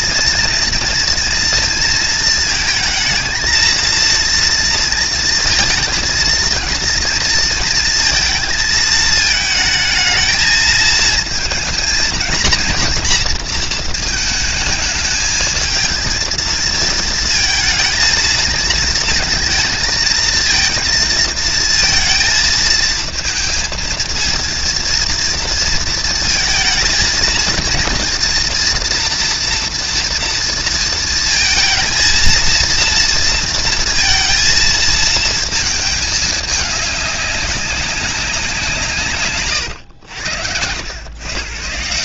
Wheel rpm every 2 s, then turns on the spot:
230, 230, 230, 230, 220, 220, 230, 220, 220, 230, 220, 230, 230, 230, 230, 230, 230, 230, 200, 150, 110.
none